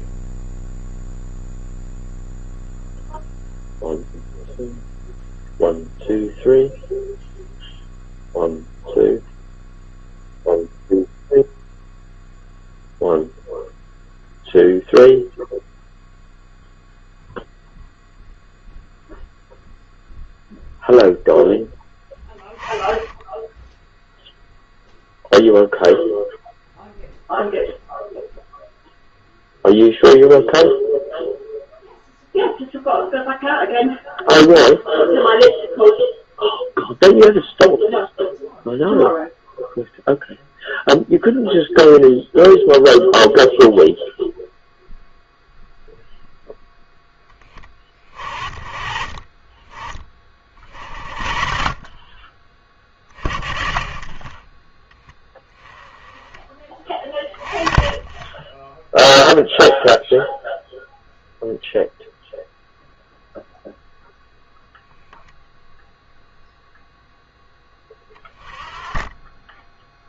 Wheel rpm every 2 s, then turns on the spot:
0, 0, 0, 0, 0, 0, 0, 0, 0, 0, 0, 20, 0, 0, 0, 0, 0, 0, 0, 0, 0, 0, 0, 10, 40, 50, 30, 10, 30, 10, 0, 0, 0, 0, 20.
none